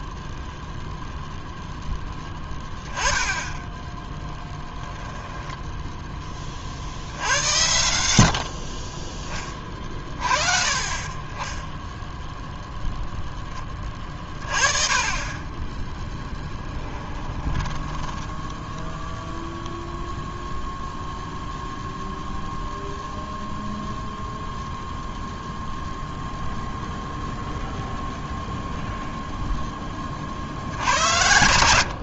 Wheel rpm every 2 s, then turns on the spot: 0, 10, 10, 60, 30, 30, 0, 20, 10, 0, 0, 0, 0, 0, 0, 60.
2-6 8-10 16-18